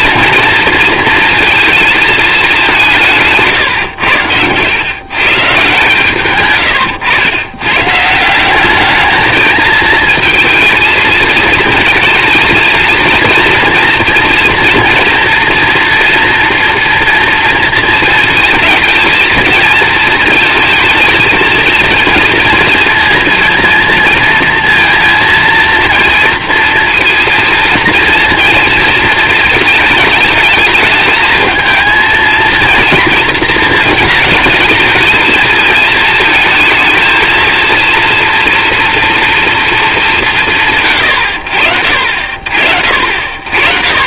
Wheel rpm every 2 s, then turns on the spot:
230, 190, 100, 120, 200, 230, 220, 230, 230, 230, 230, 230, 230, 230, 230, 220, 230, 210, 230, 240, 100, 40.
none